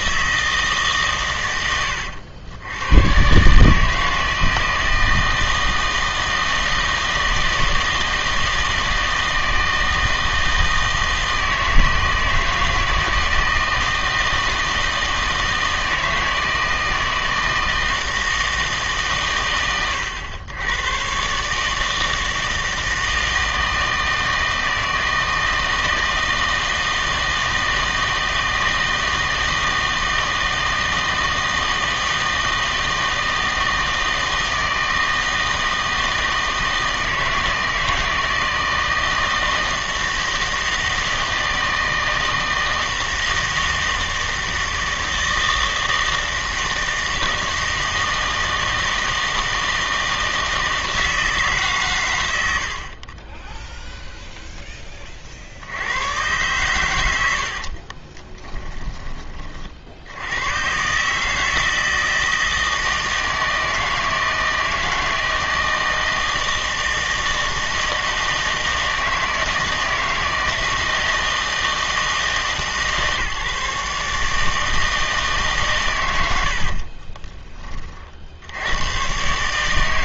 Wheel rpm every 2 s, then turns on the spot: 150, 100, 160, 160, 160, 160, 160, 160, 160, 150, 110, 160, 160, 160, 160, 160, 160, 160, 160, 160, 160, 160, 160, 160, 160, 160, 70, 10, 110, 20, 130, 160, 160, 160, 160, 160, 150, 160, 60, 100.
58-60 76-78